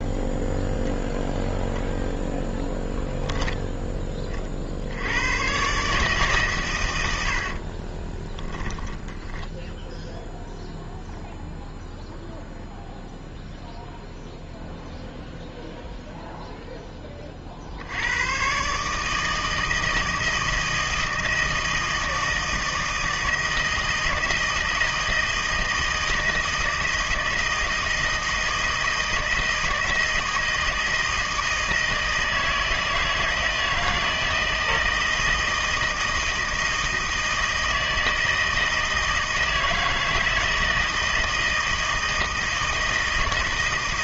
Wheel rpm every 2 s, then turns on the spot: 0, 20, 60, 120, 10, 0, 0, 0, 0, 130, 160, 160, 160, 160, 160, 160, 160, 160, 160, 160, 160, 160.
none